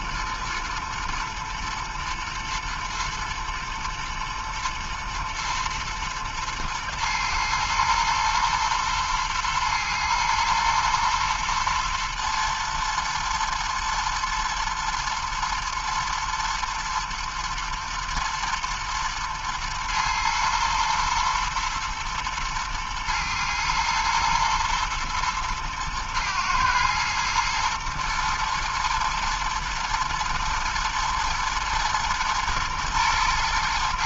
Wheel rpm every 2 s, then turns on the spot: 120, 110, 120, 110, 110, 120, 110, 110, 110, 110, 110, 110, 120, 120, 110, 120, 110.
none